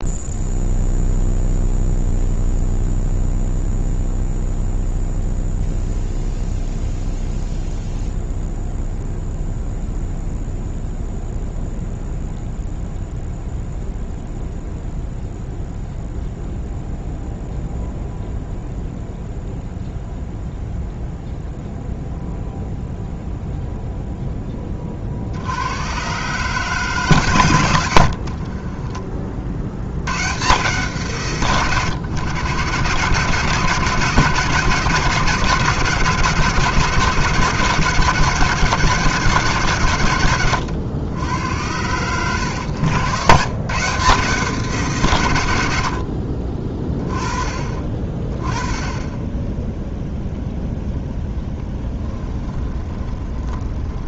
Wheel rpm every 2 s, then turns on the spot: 0, 0, 0, 0, 0, 0, 0, 0, 0, 0, 0, 0, 20, 150, 50, 140, 120, 150, 160, 130, 100, 100, 170, 40, 30, 0, 20.
28-30 42-44 52-54